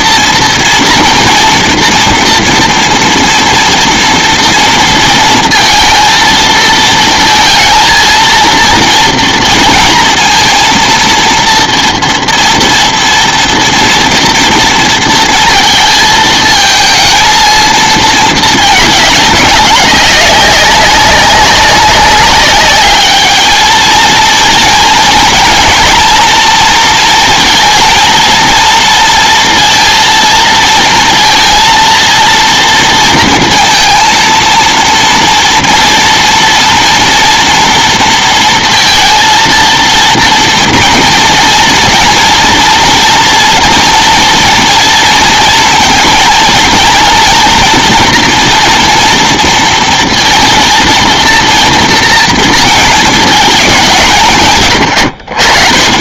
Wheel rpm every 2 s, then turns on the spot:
230, 230, 230, 220, 230, 230, 230, 230, 230, 220, 200, 200, 230, 230, 230, 230, 230, 230, 230, 230, 230, 230, 230, 230, 230, 230, 220, 120.
none